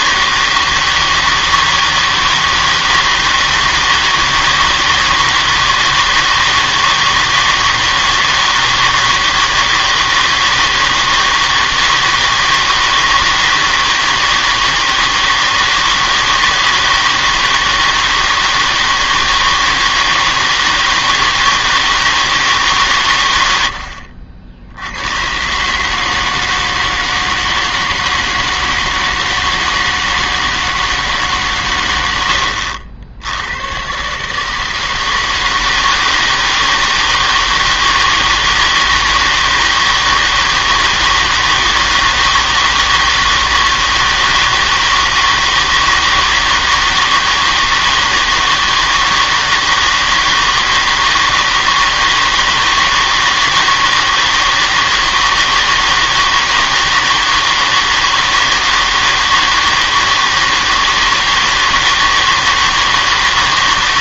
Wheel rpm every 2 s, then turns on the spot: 160, 160, 160, 160, 160, 160, 160, 160, 160, 160, 160, 150, 80, 160, 160, 160, 80, 160, 160, 160, 160, 160, 160, 160, 160, 160, 160, 160, 160, 160, 160, 160.
none